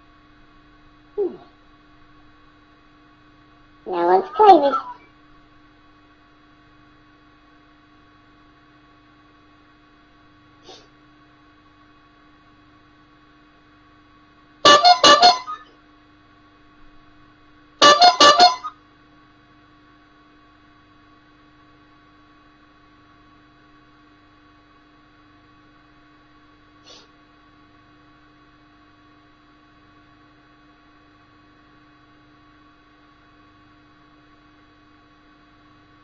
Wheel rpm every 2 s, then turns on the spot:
0, 0, 0, 0, 0, 0, 0, 0, 0, 0, 0, 0, 0, 0, 0, 0, 0, 0.
none